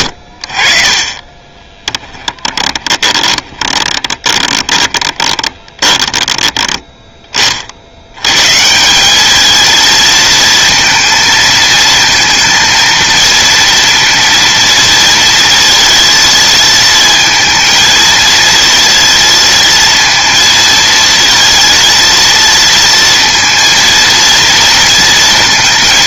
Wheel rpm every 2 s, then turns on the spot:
70, 10, 20, 10, 140, 230, 230, 230, 230, 230, 220, 230, 230.
2-6